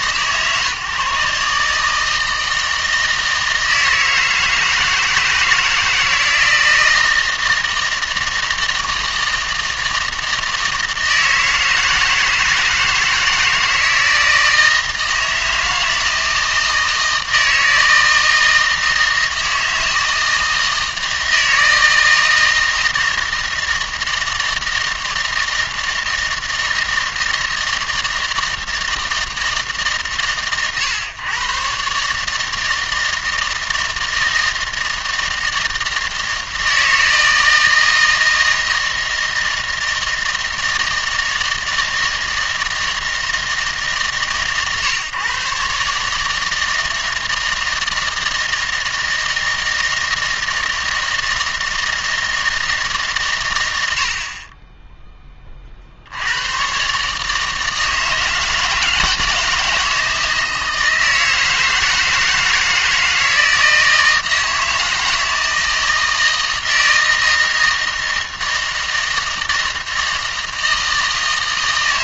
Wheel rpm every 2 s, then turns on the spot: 140, 160, 160, 160, 160, 160, 160, 160, 160, 160, 160, 160, 160, 160, 160, 110, 160, 160, 160, 160, 160, 160, 130, 160, 160, 160, 150, 10, 120, 160, 160, 160, 160, 160, 160, 160.
none